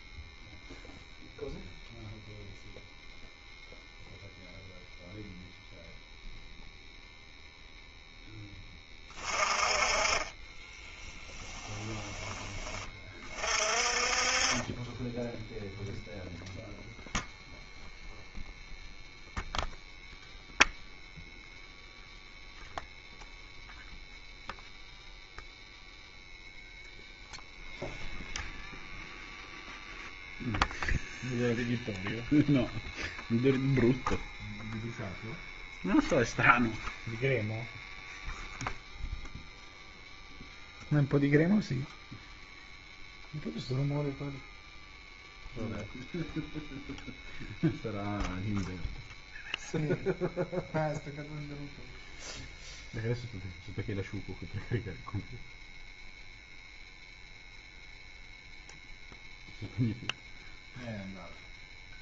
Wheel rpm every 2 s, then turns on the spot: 0, 0, 0, 0, 10, 10, 20, 20, 0, 0, 0, 0, 0, 0, 0, 0, 0, 0, 0, 0, 0, 0, 0, 0, 0, 0, 0, 0, 0, 0, 0.
10-12